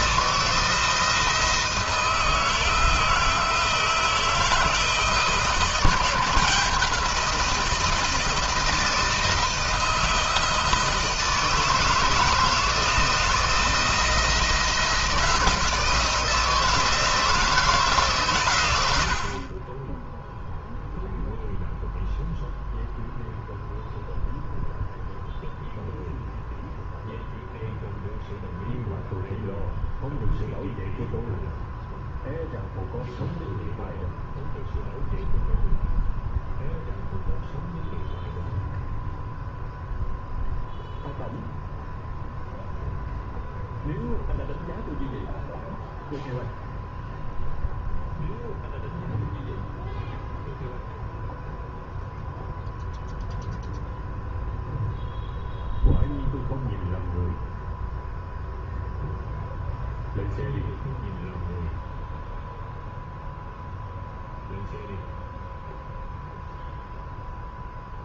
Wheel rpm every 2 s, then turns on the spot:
170, 160, 160, 170, 160, 160, 160, 160, 160, 80, 0, 0, 0, 0, 0, 0, 0, 0, 0, 0, 0, 0, 0, 0, 0, 0, 0, 0, 0, 0, 0, 0, 0, 0.
none